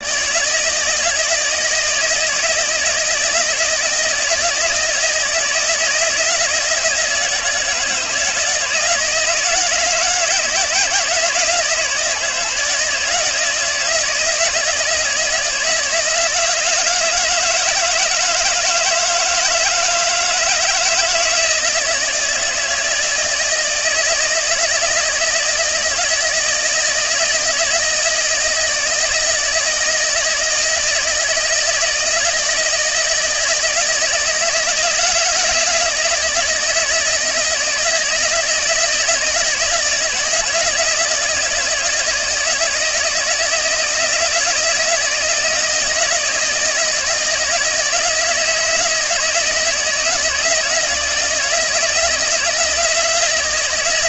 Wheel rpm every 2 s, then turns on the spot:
160, 160, 160, 160, 160, 160, 160, 160, 170, 160, 160, 160, 160, 160, 160, 160, 160, 160, 160, 160, 160, 170, 170, 160, 160, 160, 160.
none